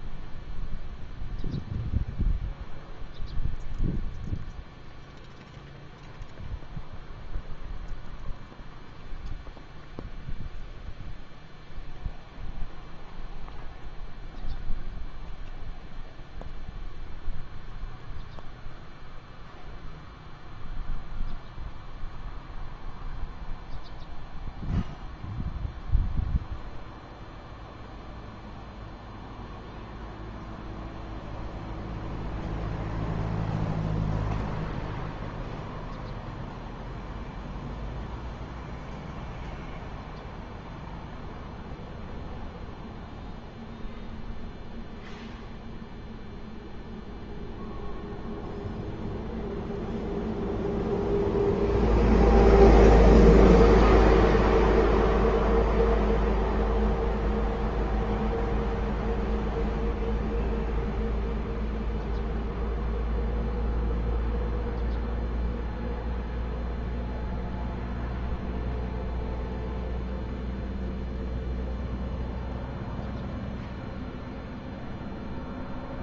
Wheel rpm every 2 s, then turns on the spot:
0, 0, 0, 0, 0, 0, 0, 0, 0, 0, 0, 0, 0, 0, 0, 0, 0, 0, 0, 0, 0, 0, 0, 0, 0, 0, 0, 0, 0, 0, 0, 0, 0, 0, 0, 0, 0, 0.
none